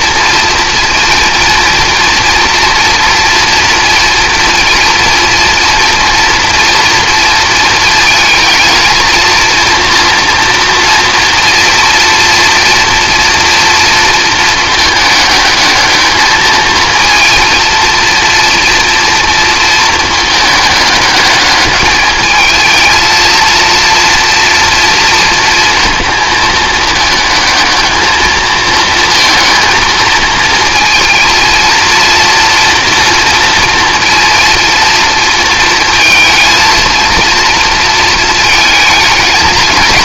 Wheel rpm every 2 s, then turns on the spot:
230, 230, 230, 230, 230, 240, 230, 220, 230, 230, 210, 220, 230, 220, 230, 230, 240, 230, 230, 220.
none